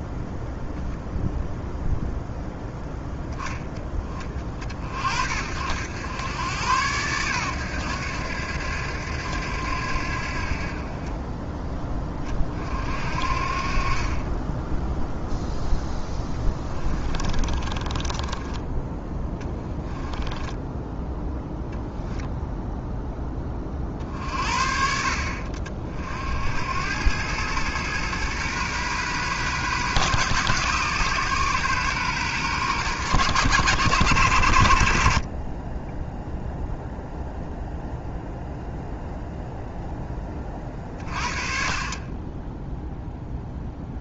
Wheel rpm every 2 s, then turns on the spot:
0, 0, 40, 110, 90, 30, 60, 10, 20, 10, 10, 0, 60, 90, 120, 130, 110, 50, 0, 0, 30, 0.
16-20